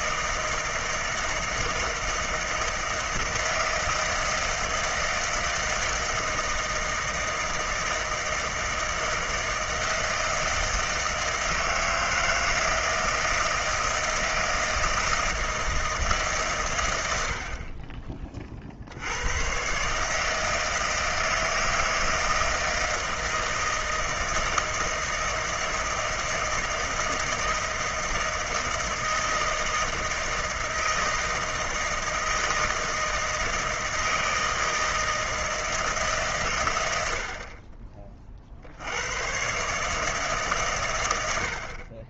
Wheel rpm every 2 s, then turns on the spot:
160, 160, 160, 160, 160, 160, 160, 160, 110, 60, 160, 160, 160, 160, 160, 160, 160, 160, 100, 70, 120.
none